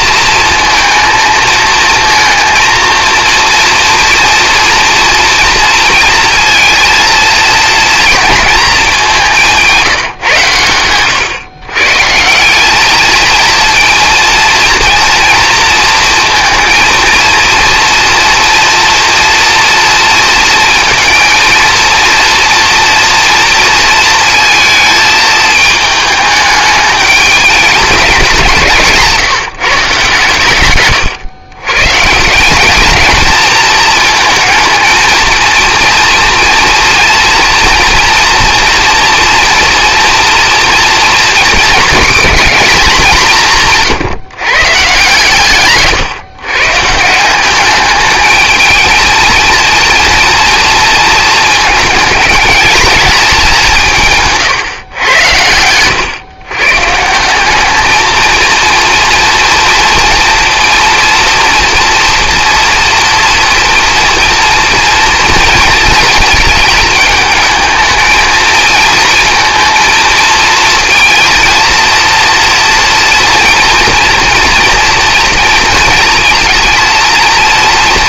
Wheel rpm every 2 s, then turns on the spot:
230, 230, 230, 230, 220, 130, 180, 230, 230, 230, 230, 230, 230, 210, 180, 130, 190, 220, 230, 230, 240, 220, 140, 130, 210, 230, 220, 150, 130, 230, 230, 230, 240, 220, 220, 230, 230, 230, 220.
none